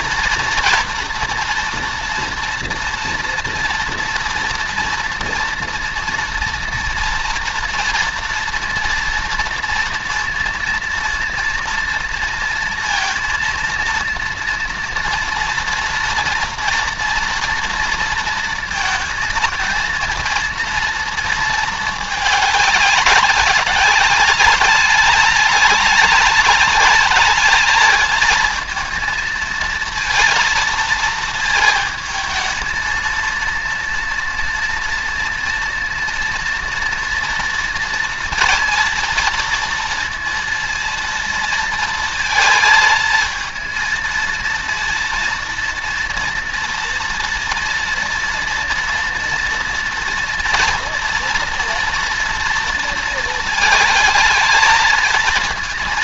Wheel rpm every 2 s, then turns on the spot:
240, 240, 230, 230, 230, 230, 230, 230, 230, 230, 230, 200, 210, 210, 220, 230, 230, 230, 230, 230, 230, 220, 230, 230, 230, 230, 230, 220.
none